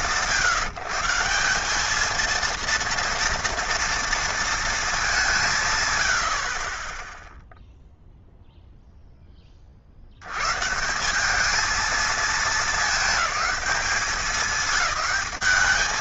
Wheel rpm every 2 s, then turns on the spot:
170, 230, 210, 20, 10, 190, 210, 180.
none